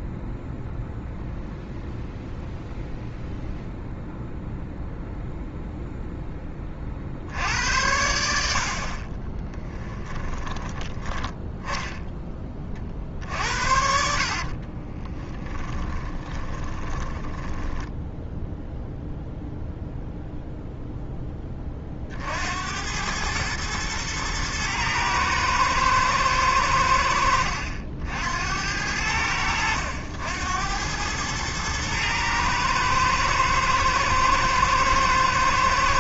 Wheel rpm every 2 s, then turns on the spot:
0, 0, 0, 40, 50, 20, 40, 30, 20, 0, 0, 90, 110, 80, 80, 100, 110, 110.
10-12 14-18